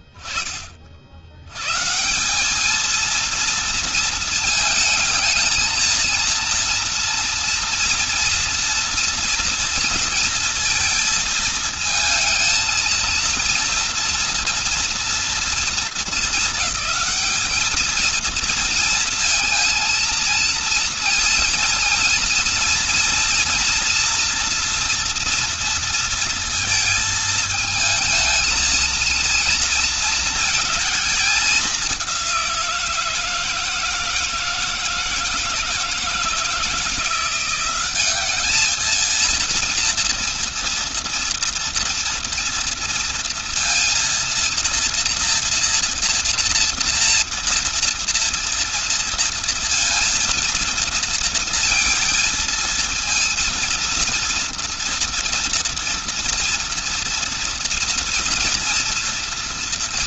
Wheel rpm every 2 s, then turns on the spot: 60, 180, 220, 230, 230, 230, 220, 230, 220, 230, 230, 230, 230, 230, 230, 220, 180, 160, 160, 220, 230, 230, 230, 230, 230, 230, 230, 230, 230, 230.
none